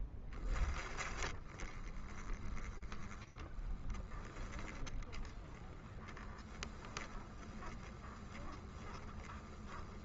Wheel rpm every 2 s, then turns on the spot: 20, 20, 20, 20, 20.
2-10